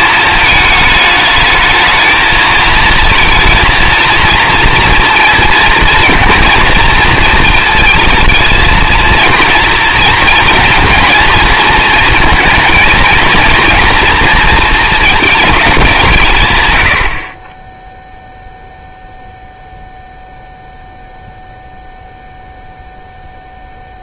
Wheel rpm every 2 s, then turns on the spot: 220, 220, 230, 240, 230, 230, 220, 220, 100, 0, 0, 0.
none